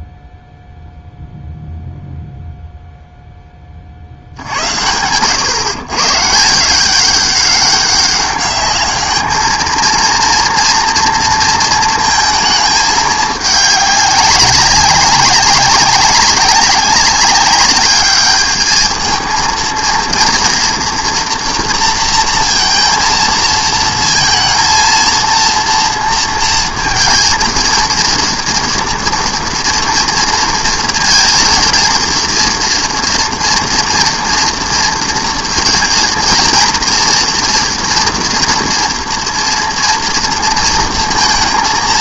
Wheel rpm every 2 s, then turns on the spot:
0, 0, 90, 180, 210, 230, 210, 190, 190, 220, 230, 230, 230, 230, 230, 230, 230, 230, 230, 230, 230.
none